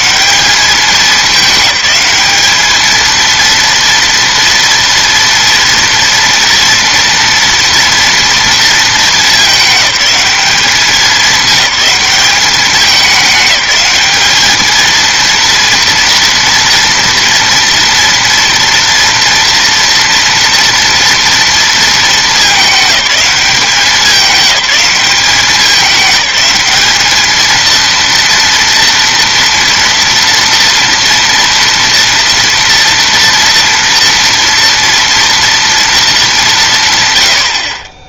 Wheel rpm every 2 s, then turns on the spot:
210, 210, 230, 230, 230, 210, 200, 210, 240, 230, 230, 220, 190, 190, 230, 230, 230, 230, 210.
none